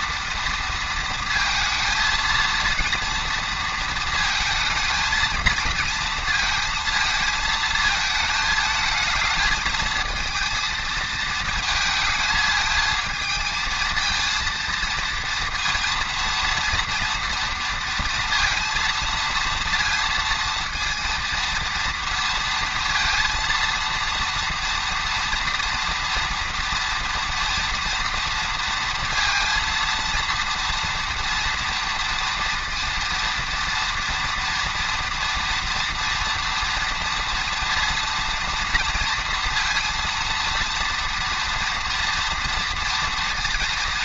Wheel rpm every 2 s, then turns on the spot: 230, 230, 220, 220, 220, 220, 220, 230, 230, 230, 230, 230, 240, 230, 230, 230, 230, 230, 230, 230, 230, 230.
none